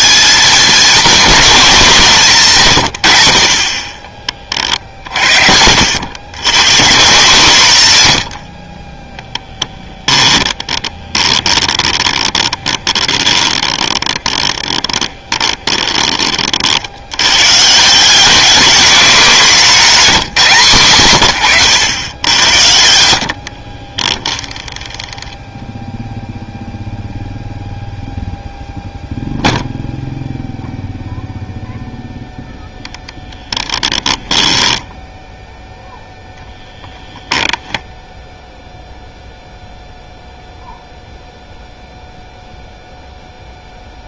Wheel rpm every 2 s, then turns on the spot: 220, 150, 40, 120, 30, 10, 20, 20, 50, 210, 140, 80, 10, 0, 0, 0, 0, 10, 0, 0, 0, 0.
8-16 24-26 34-36